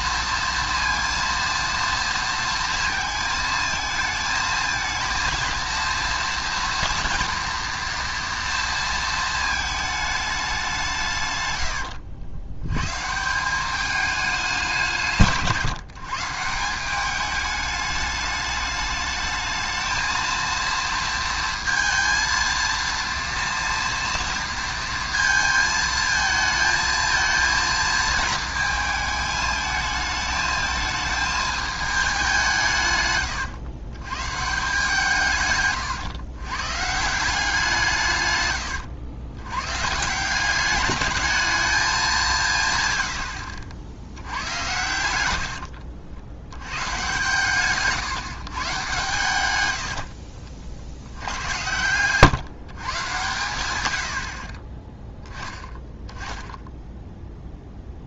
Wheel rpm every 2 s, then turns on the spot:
230, 230, 220, 230, 230, 180, 100, 190, 170, 210, 230, 230, 230, 220, 220, 220, 160, 160, 140, 100, 190, 140, 90, 100, 120, 60, 130, 40, 10.
44-46